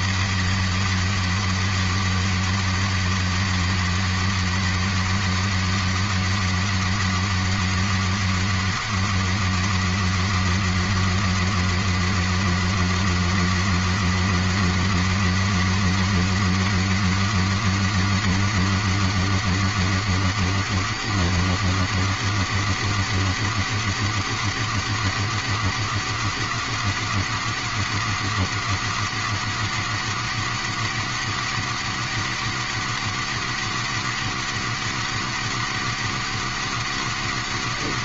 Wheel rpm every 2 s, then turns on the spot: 270, 270, 270, 270, 270, 270, 270, 270, 260, 270, 270, 270, 270, 260, 270, 270, 270, 270, 270.
none